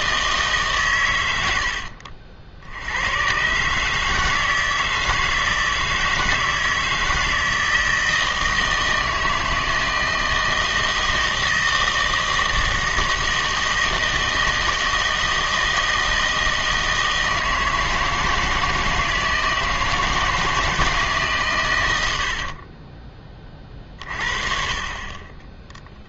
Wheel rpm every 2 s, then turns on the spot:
140, 80, 160, 160, 160, 160, 160, 160, 160, 160, 160, 50, 30.
22-24